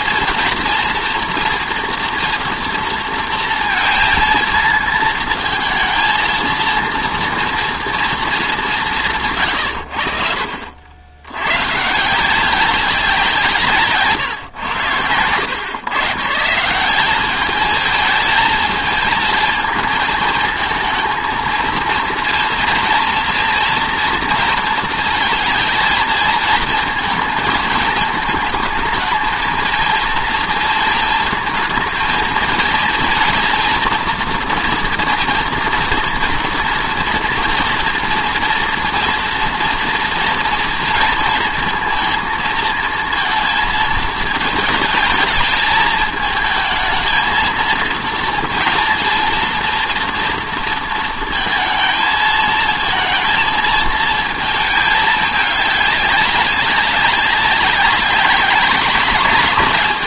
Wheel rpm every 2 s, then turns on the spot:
230, 230, 230, 230, 200, 50, 190, 110, 160, 220, 220, 230, 230, 220, 220, 230, 230, 240, 240, 230, 230, 230, 220, 220, 230, 230, 220, 220, 190, 200.
none